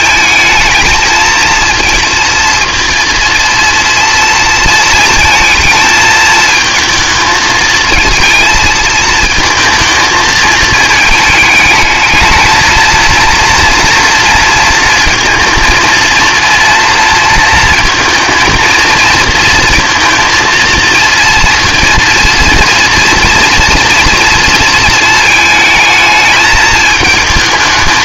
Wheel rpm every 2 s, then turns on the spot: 220, 230, 230, 220, 220, 220, 230, 230, 230, 220, 230, 230, 230, 220.
none